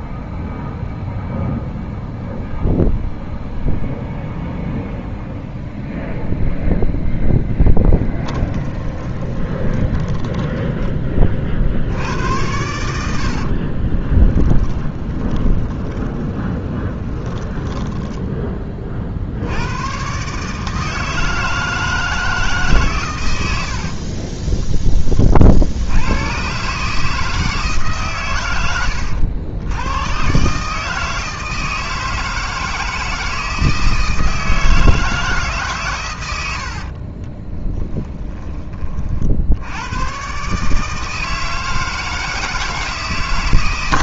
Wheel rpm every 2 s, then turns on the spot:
0, 0, 0, 0, 10, 20, 80, 20, 20, 40, 160, 130, 20, 150, 90, 150, 160, 160, 50, 50, 150, 160.
8-10 12-18 36-38